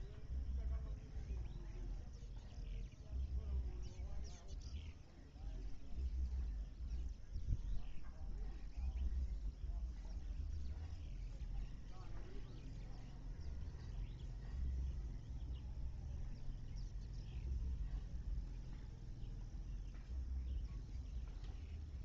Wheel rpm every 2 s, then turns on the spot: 0, 0, 0, 0, 0, 0, 0, 0, 0, 0, 0.
none